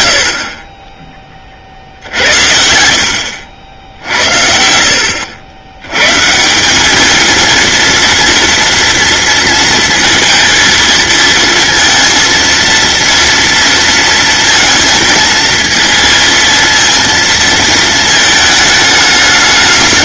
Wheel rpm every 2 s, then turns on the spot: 50, 80, 100, 230, 230, 230, 230, 230, 230, 210.
none